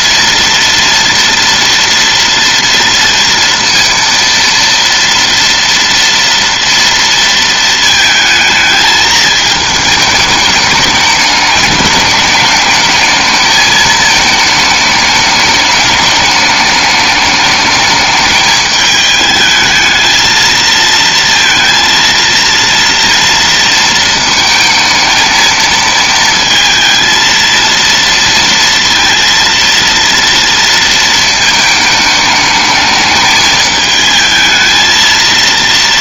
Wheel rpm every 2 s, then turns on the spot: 230, 230, 230, 230, 220, 210, 210, 220, 210, 210, 220, 230, 220, 220, 230, 230, 220, 220.
none